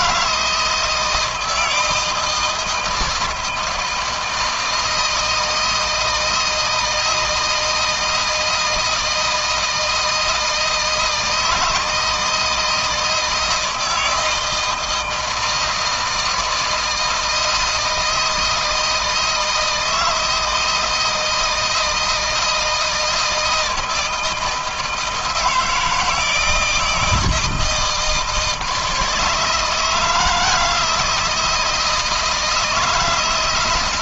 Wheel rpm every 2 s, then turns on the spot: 160, 160, 160, 160, 160, 160, 160, 170, 170, 160, 160, 160, 160, 160, 160, 160, 160.
none